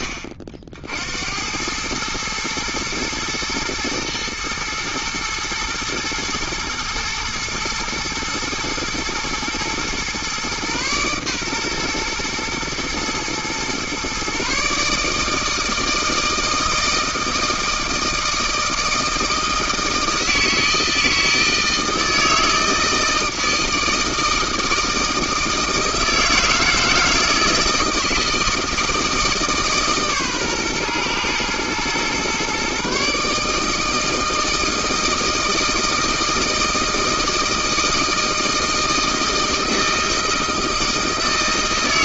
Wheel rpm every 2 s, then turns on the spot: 50, 110, 110, 110, 120, 120, 120, 140, 160, 160, 160, 160, 160, 160, 160, 130, 130, 160, 160, 160, 160.
none